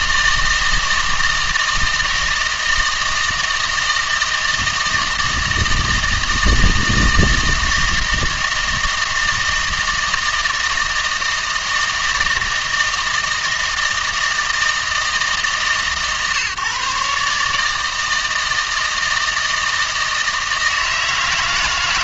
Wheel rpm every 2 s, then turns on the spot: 160, 160, 170, 160, 160, 160, 160, 160, 140, 160, 160.
none